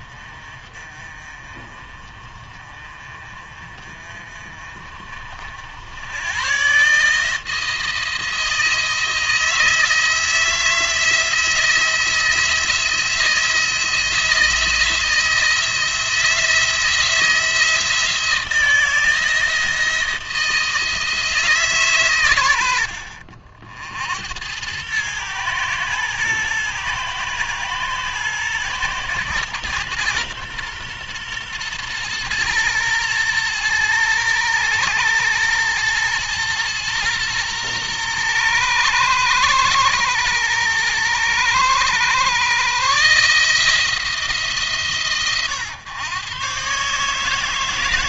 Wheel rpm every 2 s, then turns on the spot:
40, 40, 40, 130, 160, 160, 170, 160, 160, 160, 160, 100, 100, 110, 120, 120, 120, 110, 110, 110, 110, 130, 150, 130.
none